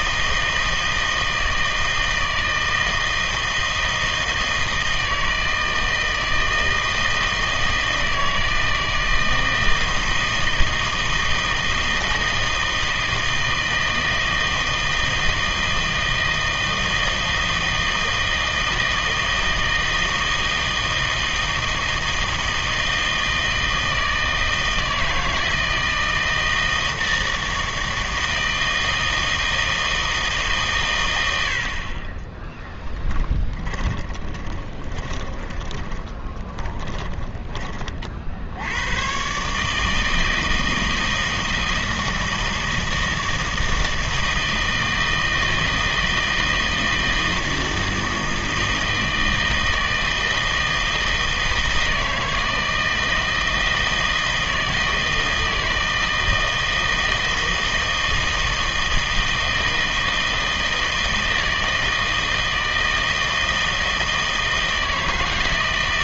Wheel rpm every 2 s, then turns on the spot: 160, 160, 160, 160, 160, 160, 160, 160, 160, 160, 160, 160, 160, 160, 160, 140, 10, 20, 30, 90, 160, 160, 160, 160, 160, 160, 160, 160, 160, 160, 160, 160, 160.
32-38